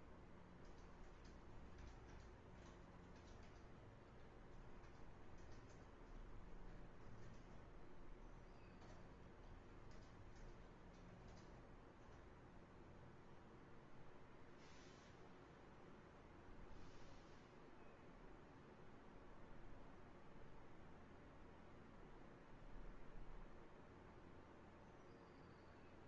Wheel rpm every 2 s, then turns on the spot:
0, 0, 0, 0, 0, 0, 0, 0, 0, 0, 0, 0, 0.
none